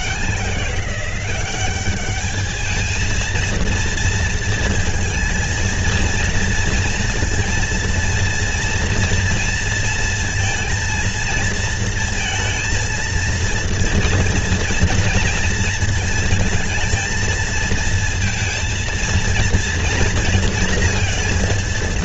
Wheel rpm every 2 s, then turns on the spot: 180, 220, 220, 230, 230, 230, 230, 230, 230, 230, 230.
none